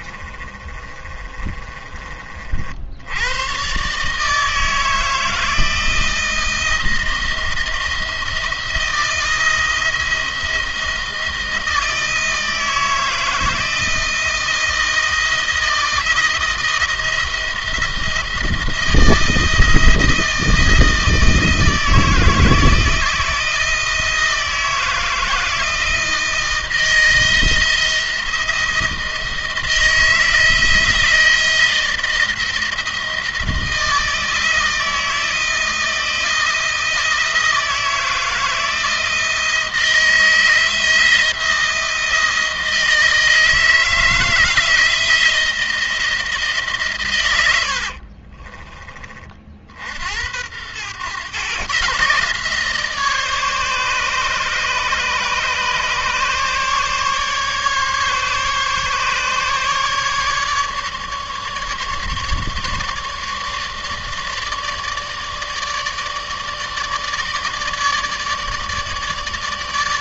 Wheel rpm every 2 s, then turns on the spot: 30, 60, 160, 160, 170, 170, 160, 170, 160, 160, 170, 160, 160, 160, 160, 160, 160, 160, 170, 160, 170, 160, 160, 140, 30, 110, 150, 150, 150, 140, 150, 150, 150, 150, 150.
0-2